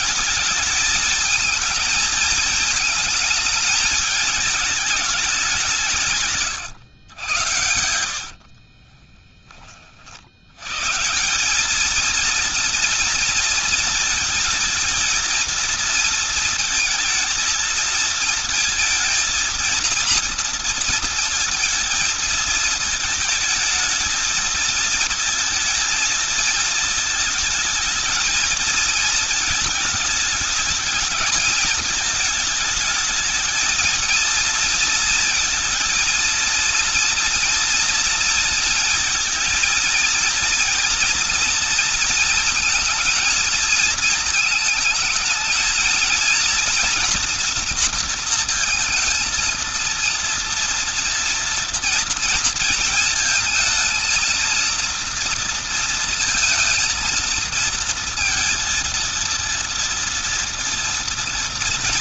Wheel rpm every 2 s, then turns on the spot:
210, 220, 210, 110, 50, 150, 230, 220, 230, 230, 230, 220, 220, 220, 220, 220, 210, 230, 230, 220, 230, 220, 220, 230, 220, 230, 230, 230, 230, 230, 230.
8-10